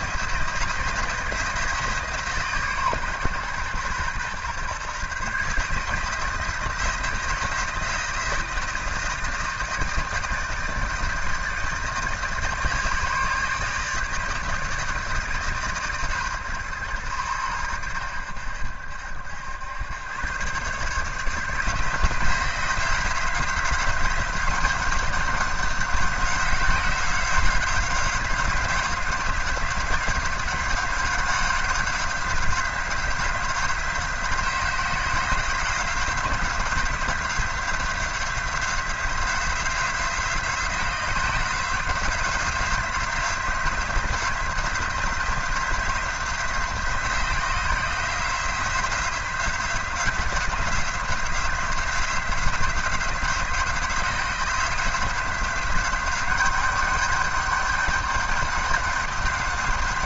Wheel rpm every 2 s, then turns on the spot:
170, 140, 130, 170, 160, 160, 150, 160, 120, 80, 130, 170, 190, 180, 180, 190, 180, 180, 180, 180, 180, 180, 180, 180, 180, 180, 180, 180, 200, 200.
none